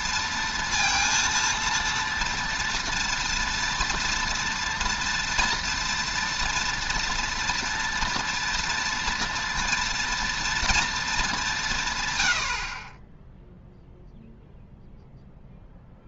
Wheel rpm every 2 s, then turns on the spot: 230, 240, 240, 240, 230, 230, 50, 0.
none